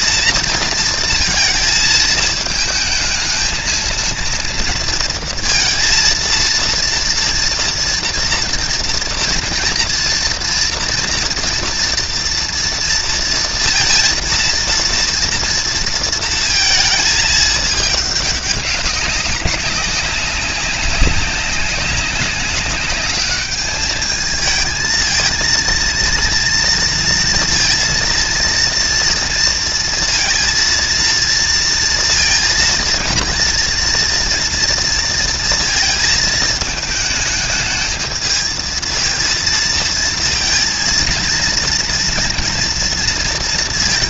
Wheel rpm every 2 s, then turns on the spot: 230, 220, 220, 230, 230, 230, 230, 230, 220, 190, 190, 200, 220, 230, 230, 230, 230, 230, 220, 230, 220, 240.
none